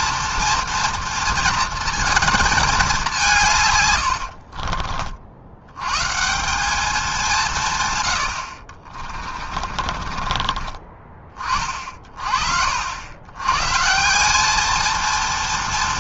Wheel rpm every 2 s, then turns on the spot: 230, 220, 60, 180, 50, 30, 50, 210.
4-6 8-12